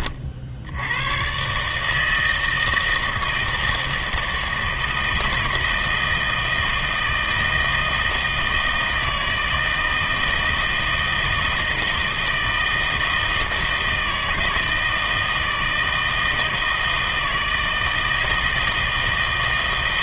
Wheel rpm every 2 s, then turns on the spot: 80, 160, 160, 160, 160, 160, 160, 160, 160, 160.
none